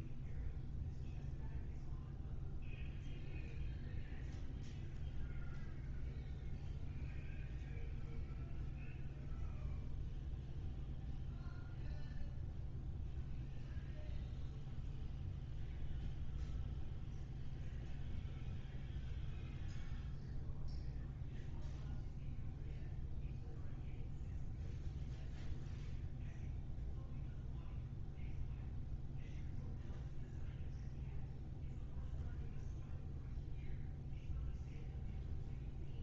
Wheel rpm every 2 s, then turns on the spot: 0, 0, 0, 0, 0, 0, 0, 0, 0, 0, 0, 0, 0, 0, 0, 0, 0, 0.
none